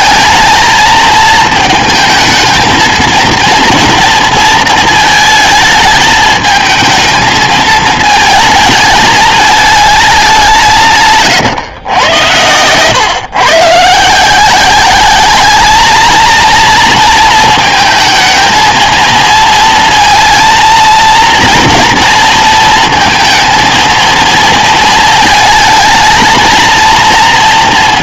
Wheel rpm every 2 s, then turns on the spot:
220, 220, 220, 220, 220, 170, 110, 190, 220, 220, 230, 230, 230, 230.
none